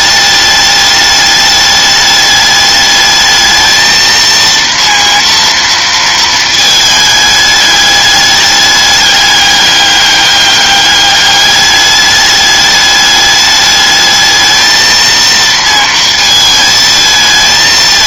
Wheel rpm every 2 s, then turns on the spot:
210, 210, 230, 220, 200, 200, 210, 220, 220.
none